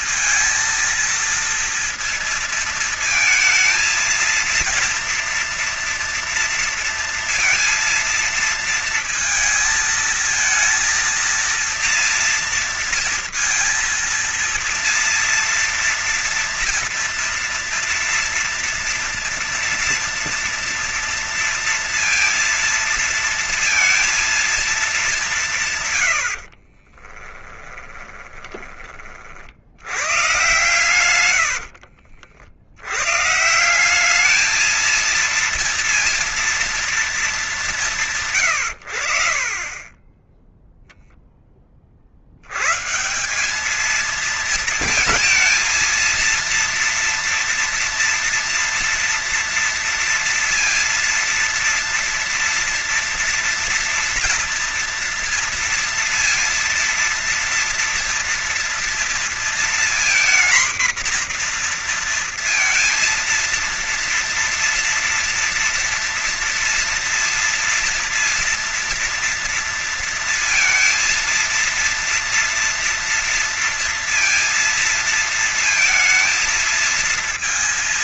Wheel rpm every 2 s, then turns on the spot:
230, 230, 230, 230, 230, 230, 230, 230, 230, 230, 230, 230, 220, 70, 20, 110, 80, 210, 230, 120, 10, 90, 230, 230, 230, 230, 230, 230, 230, 230, 230, 230, 230, 230, 230, 230, 230, 230, 230.
26-28 30-32